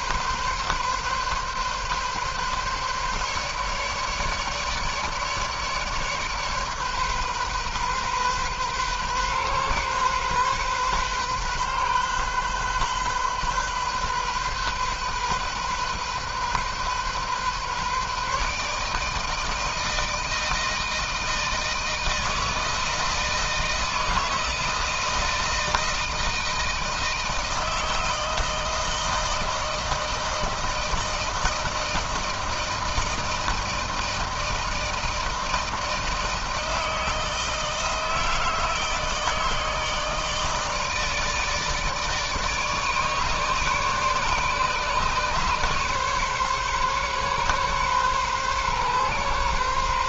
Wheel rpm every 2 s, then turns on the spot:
140, 140, 150, 140, 130, 130, 130, 130, 130, 150, 160, 160, 160, 160, 160, 160, 160, 160, 160, 160, 160, 150, 140, 140, 130.
none